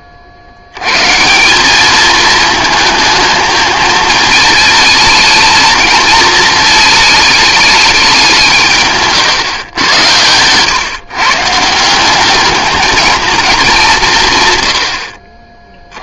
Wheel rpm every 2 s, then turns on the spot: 70, 220, 220, 220, 150, 120, 210, 110.
none